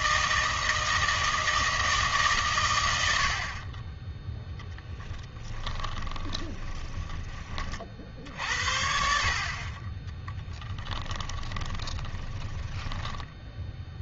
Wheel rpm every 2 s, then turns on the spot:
160, 120, 0, 20, 60, 20, 10.
6-8 10-14